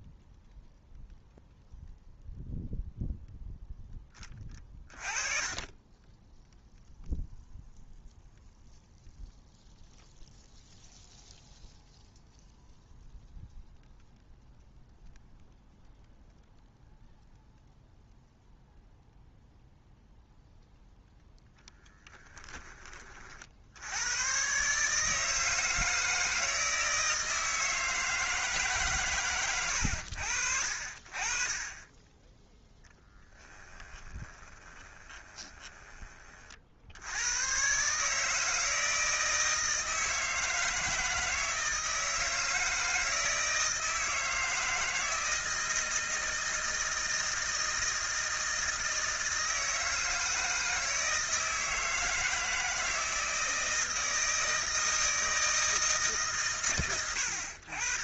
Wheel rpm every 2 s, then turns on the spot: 0, 0, 20, 0, 0, 0, 0, 0, 0, 0, 0, 30, 150, 160, 130, 50, 10, 20, 70, 160, 160, 160, 160, 160, 160, 160, 160, 160, 110.
32-36